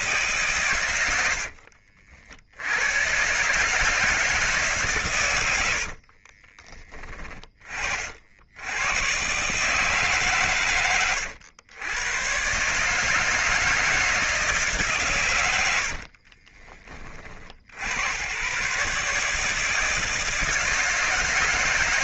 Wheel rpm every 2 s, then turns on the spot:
140, 80, 150, 40, 90, 110, 140, 160, 30, 130, 160.
6-8